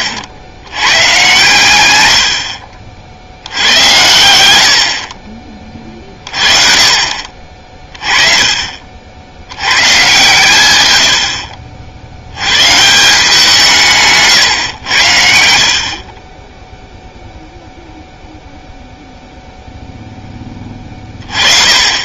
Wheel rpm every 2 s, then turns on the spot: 100, 50, 70, 30, 40, 110, 130, 110, 10, 0, 20.
none